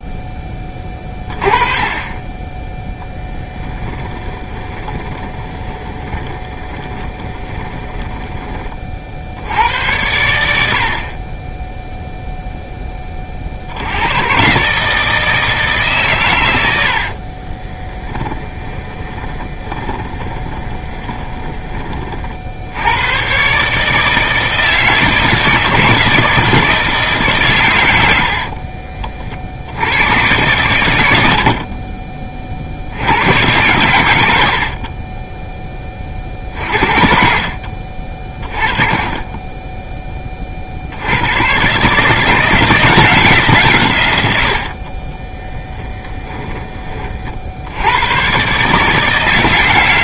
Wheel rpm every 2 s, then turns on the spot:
40, 10, 10, 20, 30, 60, 20, 150, 70, 30, 30, 90, 160, 160, 40, 110, 70, 40, 50, 30, 70, 170, 50, 30, 150.
4-8 18-22 28-30